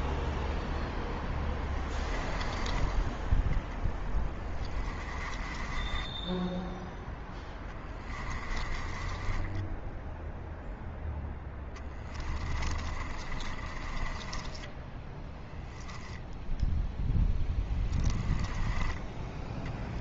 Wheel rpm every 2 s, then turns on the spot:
0, 10, 10, 0, 20, 0, 20, 10, 0, 10.
2-6 8-10 12-16 18-20